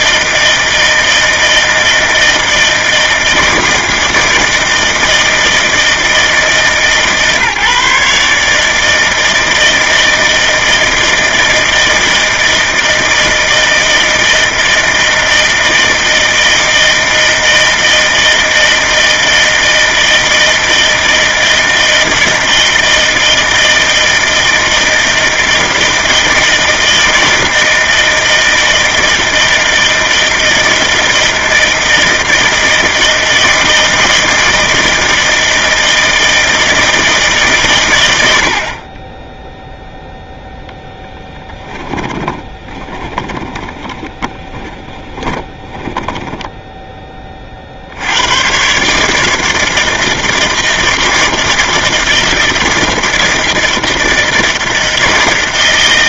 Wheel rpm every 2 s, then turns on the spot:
160, 160, 160, 160, 150, 160, 160, 160, 160, 160, 160, 160, 160, 160, 160, 160, 160, 160, 160, 70, 0, 20, 20, 20, 110, 160, 160, 160.
42-48